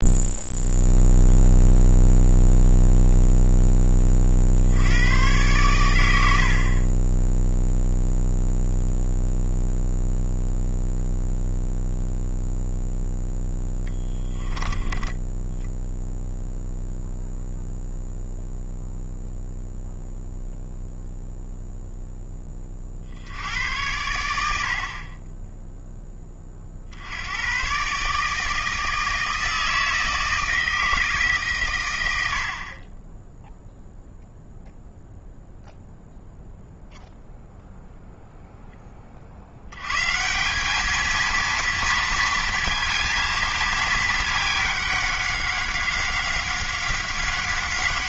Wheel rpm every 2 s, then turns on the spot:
0, 0, 70, 40, 0, 0, 0, 20, 0, 0, 0, 30, 60, 40, 160, 160, 50, 0, 0, 10, 190, 230, 210, 190.
none